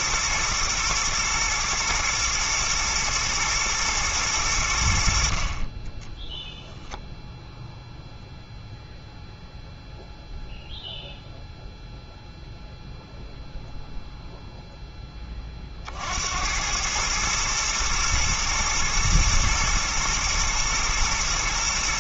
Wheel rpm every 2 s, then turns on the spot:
120, 120, 90, 10, 0, 0, 0, 0, 100, 110, 110.
none